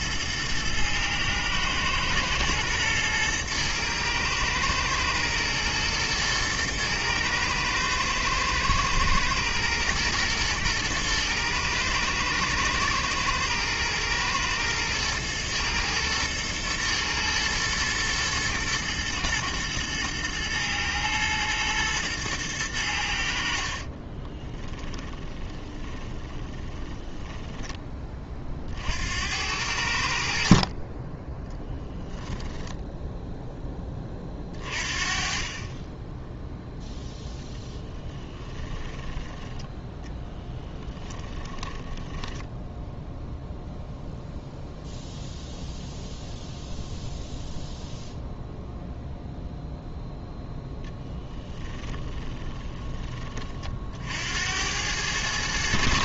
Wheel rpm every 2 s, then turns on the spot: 120, 120, 110, 110, 110, 110, 110, 110, 120, 110, 110, 100, 20, 20, 50, 40, 10, 40, 0, 20, 10, 0, 0, 0, 0, 0, 10, 90.
24-28 32-34 38-42